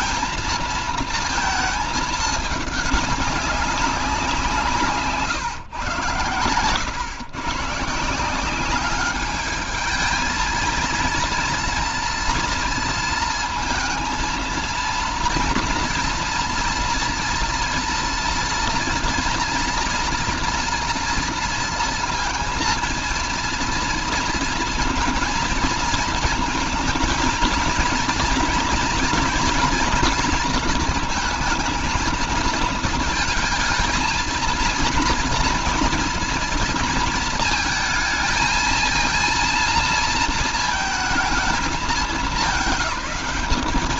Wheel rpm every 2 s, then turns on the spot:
230, 210, 160, 130, 200, 230, 230, 230, 230, 240, 240, 230, 230, 220, 230, 230, 230, 230, 230, 230, 220, 190.
none